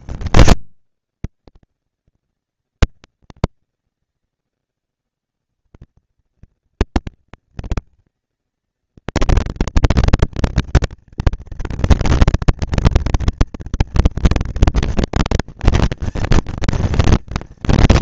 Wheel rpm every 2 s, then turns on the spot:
190, 190, 200, 220, 230, 230, 230, 230, 240.
none